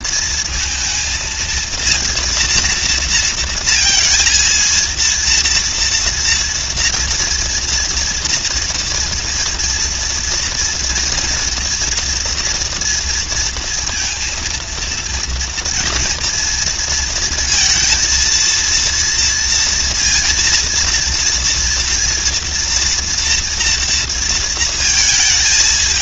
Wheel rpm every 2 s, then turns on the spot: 230, 230, 230, 230, 230, 230, 240, 230, 230, 230, 230, 230, 230.
none